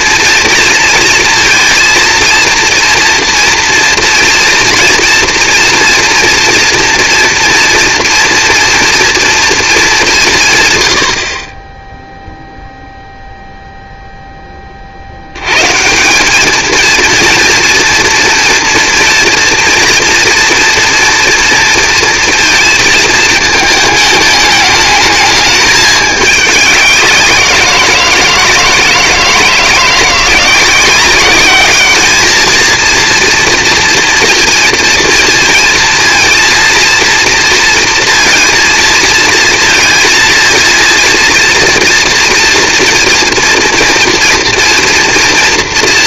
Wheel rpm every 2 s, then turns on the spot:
230, 230, 230, 230, 240, 140, 0, 30, 220, 230, 230, 230, 210, 200, 160, 180, 220, 230, 230, 230, 230, 240, 230.
none